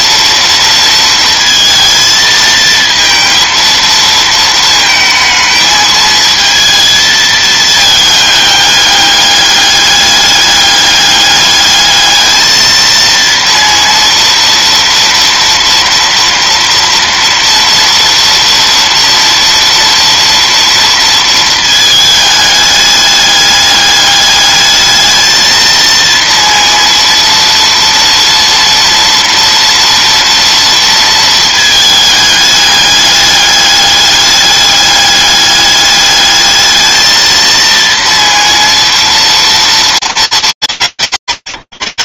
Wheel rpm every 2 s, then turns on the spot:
230, 220, 220, 220, 210, 200, 220, 230, 230, 230, 230, 210, 210, 230, 240, 230, 210, 200, 220, 230, 170.
none